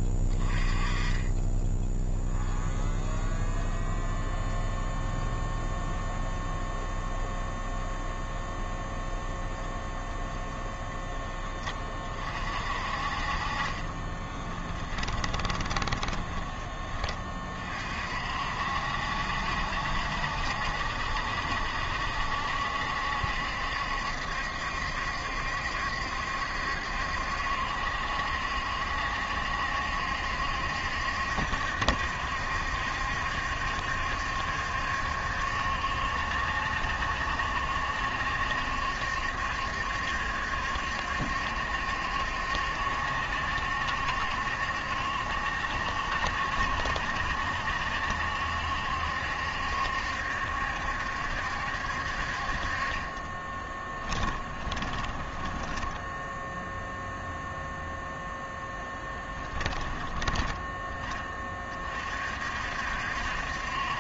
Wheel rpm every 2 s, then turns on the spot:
20, 0, 0, 0, 0, 10, 40, 20, 20, 60, 70, 70, 70, 70, 70, 70, 70, 70, 70, 70, 70, 70, 70, 70, 70, 70, 30, 20, 0, 10, 20, 60.
14-16 52-56